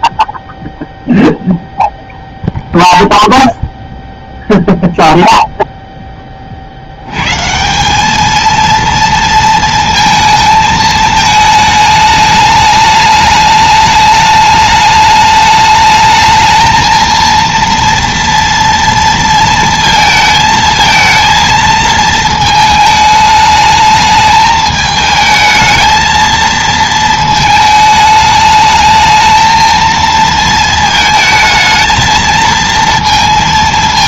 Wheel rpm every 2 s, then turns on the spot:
0, 0, 0, 70, 230, 220, 210, 210, 220, 230, 220, 220, 220, 230, 220, 220, 230.
none